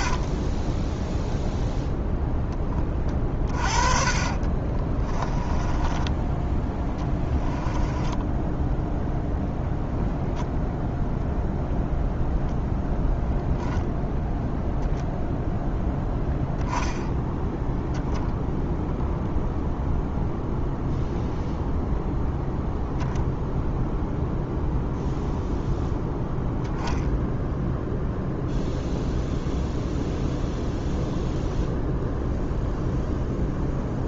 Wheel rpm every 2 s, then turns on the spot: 10, 20, 30, 10, 0, 10, 0, 10, 10, 0, 0, 0, 0, 0, 0, 0, 0.
0-2 4-6